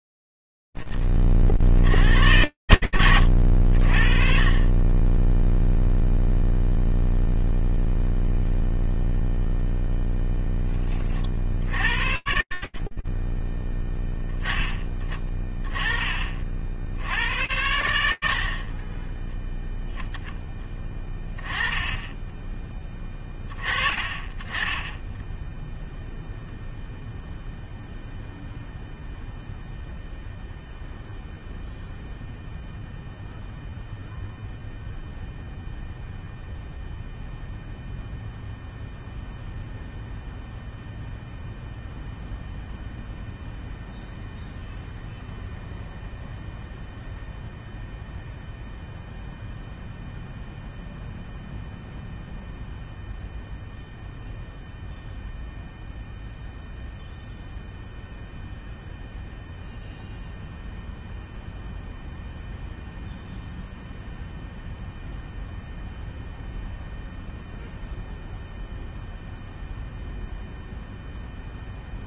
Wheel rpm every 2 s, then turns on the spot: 0, 80, 20, 0, 0, 50, 30, 20, 100, 20, 20, 20, 10, 0, 0, 0, 0, 0, 0, 0, 0, 0, 0, 0, 0, 0, 0, 0, 0, 0, 0, 0, 0, 0, 0, 0.
none